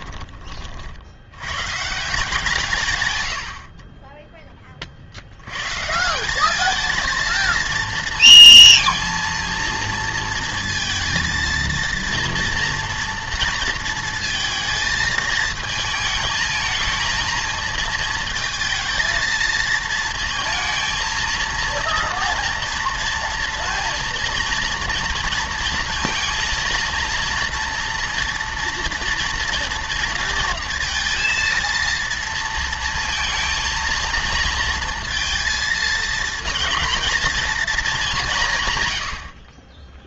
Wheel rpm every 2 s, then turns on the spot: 40, 140, 30, 210, 230, 230, 230, 230, 220, 220, 220, 230, 230, 230, 230, 230, 230, 220, 230, 130.
none